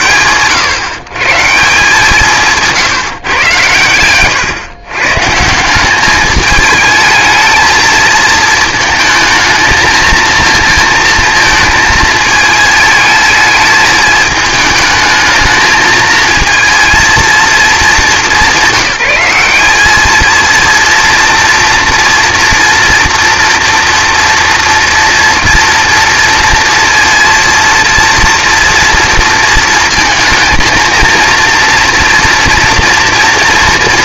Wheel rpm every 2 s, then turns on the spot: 100, 160, 130, 210, 220, 230, 220, 220, 220, 190, 230, 230, 230, 230, 230, 230, 240.
none